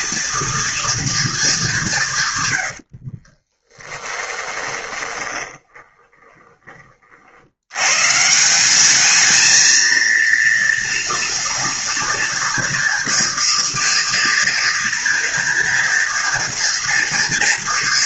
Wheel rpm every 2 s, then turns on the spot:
240, 100, 20, 30, 190, 230, 240, 240, 230.
2-6